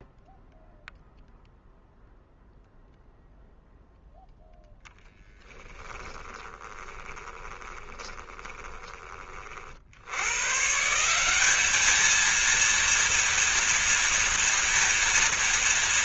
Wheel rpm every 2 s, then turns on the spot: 0, 0, 0, 20, 20, 160, 230, 230.
6-8